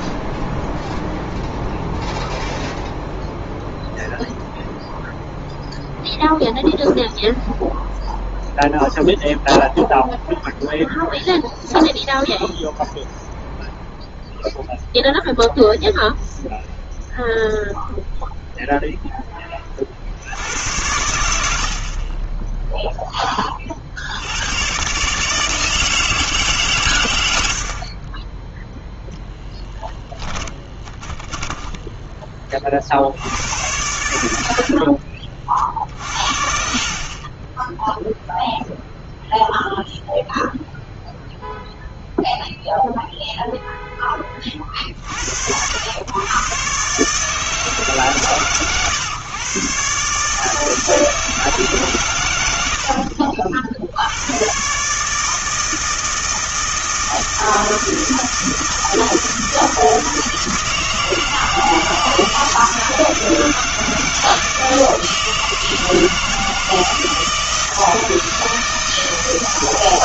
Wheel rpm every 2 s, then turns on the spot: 0, 0, 0, 0, 0, 0, 0, 0, 0, 0, 90, 0, 110, 140, 0, 20, 30, 60, 50, 0, 0, 0, 40, 130, 130, 160, 100, 120, 160, 160, 160, 160, 160, 160, 160.
30-32